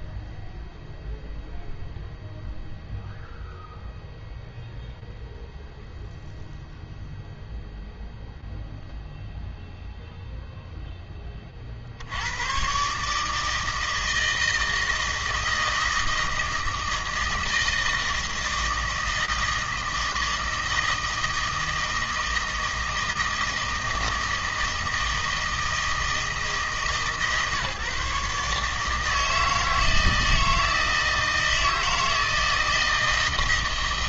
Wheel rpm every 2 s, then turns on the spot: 0, 0, 0, 0, 0, 0, 130, 160, 160, 160, 160, 160, 160, 150, 150, 160, 160.
none